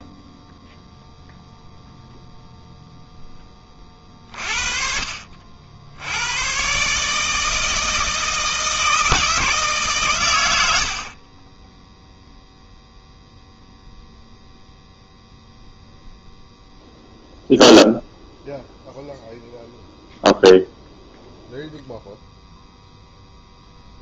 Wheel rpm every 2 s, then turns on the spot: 0, 0, 50, 150, 160, 40, 0, 0, 0, 0, 0, 0.
10-12